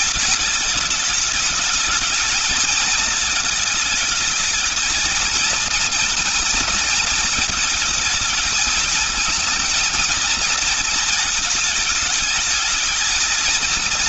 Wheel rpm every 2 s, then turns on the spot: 210, 220, 210, 230, 220, 230, 220.
none